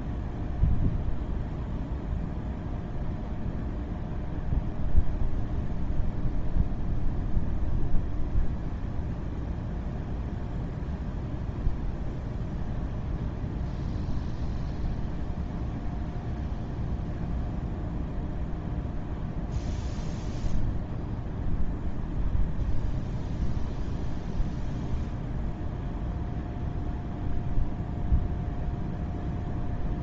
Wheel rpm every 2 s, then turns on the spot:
0, 0, 0, 0, 0, 0, 0, 0, 0, 0, 0, 0, 0, 0, 0.
none